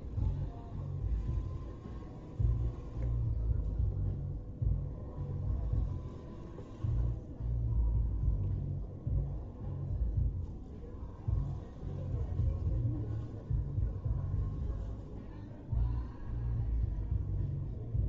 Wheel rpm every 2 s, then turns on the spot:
0, 0, 0, 0, 0, 0, 0, 0, 0.
none